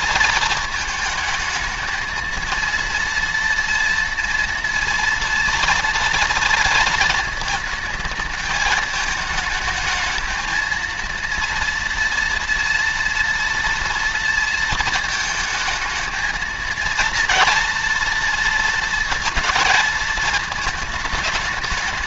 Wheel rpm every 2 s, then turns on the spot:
220, 230, 230, 230, 210, 230, 230, 220, 230, 230, 220.
none